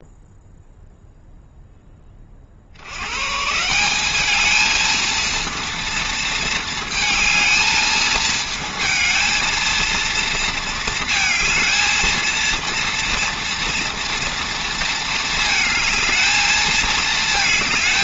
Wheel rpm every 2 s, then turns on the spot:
0, 80, 220, 220, 220, 230, 230, 230, 220.
none